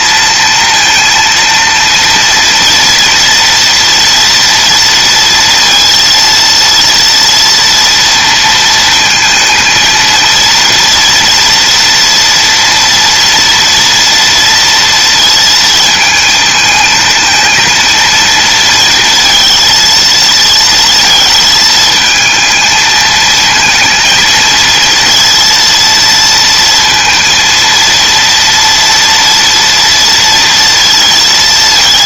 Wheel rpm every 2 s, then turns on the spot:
230, 230, 230, 230, 230, 230, 230, 230, 230, 230, 230, 220, 230, 230, 230, 230.
none